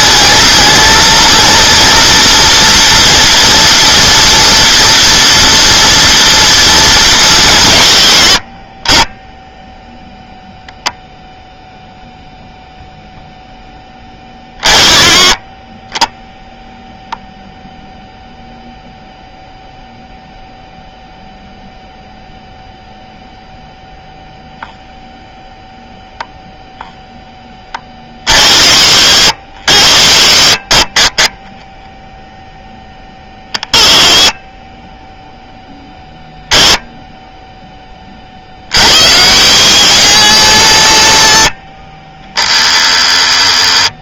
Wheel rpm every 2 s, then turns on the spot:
230, 230, 230, 220, 40, 0, 0, 20, 0, 0, 0, 0, 0, 0, 110, 50, 10, 20, 10, 60, 90, 10.
none